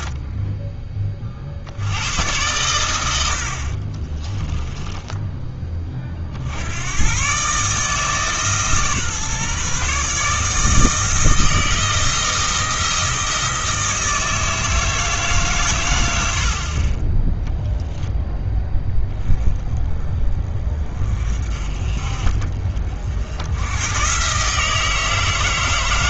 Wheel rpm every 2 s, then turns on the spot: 20, 100, 10, 80, 150, 160, 170, 160, 50, 10, 30, 50, 150.
4-6